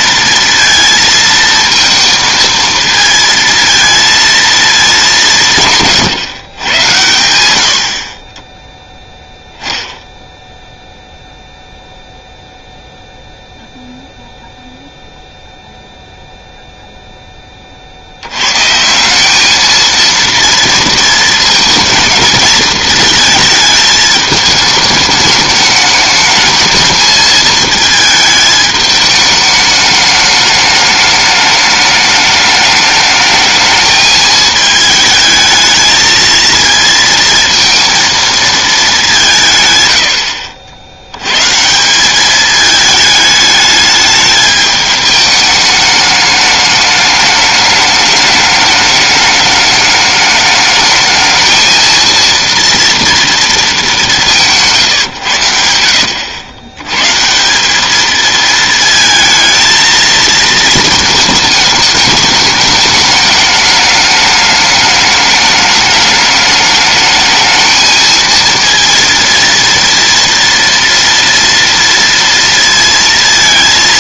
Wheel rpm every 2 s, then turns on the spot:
230, 230, 210, 100, 10, 0, 0, 0, 0, 150, 230, 220, 210, 220, 210, 210, 210, 220, 230, 210, 70, 210, 210, 210, 210, 220, 230, 150, 110, 220, 220, 210, 210, 210, 230, 230, 230.
none